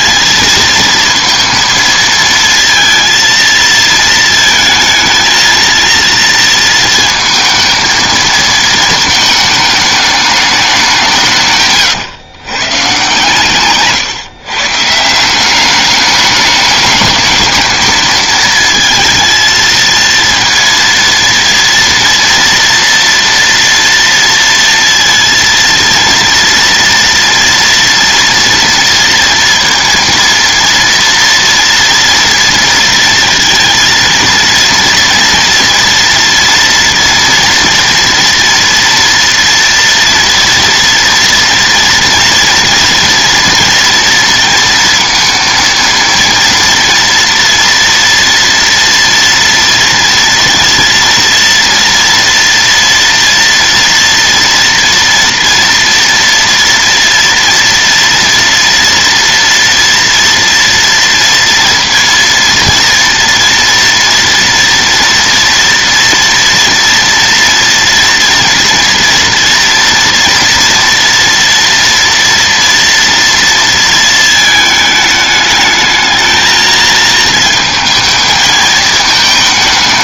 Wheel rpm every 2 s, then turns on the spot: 230, 230, 220, 230, 220, 200, 120, 130, 210, 230, 230, 240, 230, 230, 230, 230, 230, 230, 230, 230, 230, 230, 230, 230, 230, 230, 230, 230, 230, 230, 230, 230, 230, 230, 230, 240, 230, 220, 220, 220.
none